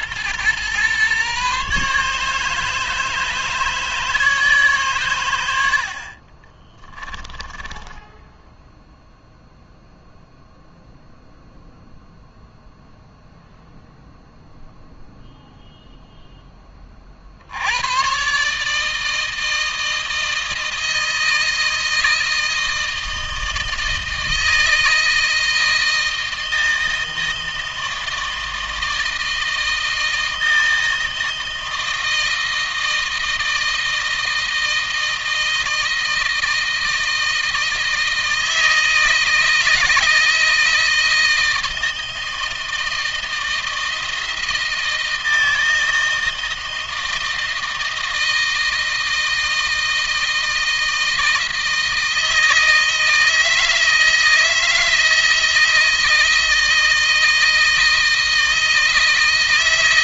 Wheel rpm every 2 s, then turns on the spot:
130, 150, 120, 10, 0, 0, 0, 0, 20, 150, 160, 160, 160, 160, 160, 170, 160, 160, 160, 160, 160, 160, 160, 160, 160, 160, 160, 160, 160, 160.
6-8